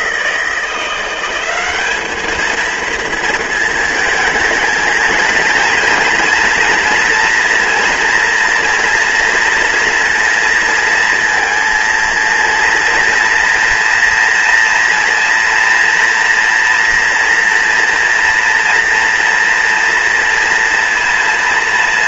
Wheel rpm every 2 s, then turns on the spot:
170, 220, 220, 230, 230, 230, 230, 230, 230, 230, 240.
none